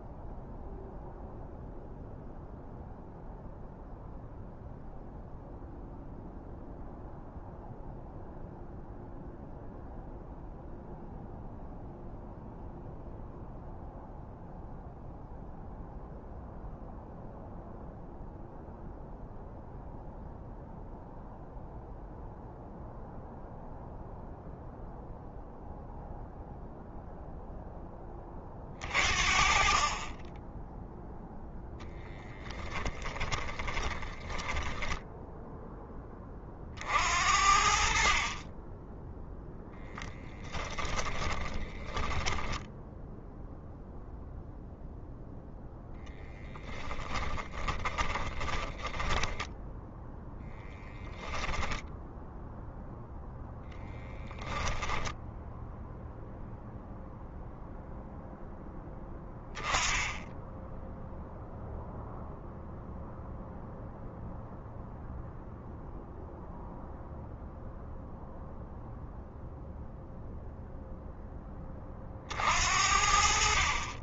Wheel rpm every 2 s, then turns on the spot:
0, 0, 0, 0, 0, 0, 0, 0, 0, 0, 0, 0, 0, 0, 50, 0, 20, 10, 50, 10, 20, 10, 0, 20, 10, 10, 0, 10, 0, 0, 0, 0, 0, 0, 0, 0, 60.
32-36 40-44 46-50 54-56